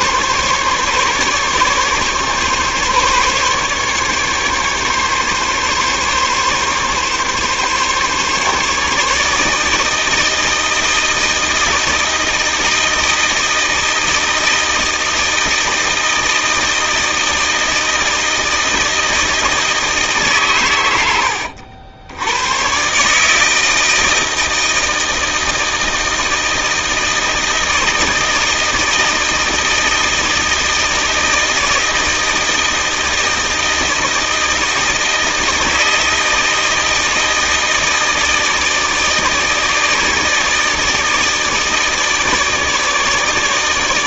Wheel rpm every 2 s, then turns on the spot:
140, 140, 140, 140, 150, 160, 160, 160, 160, 160, 90, 130, 160, 160, 160, 160, 160, 160, 170, 160, 160, 160.
none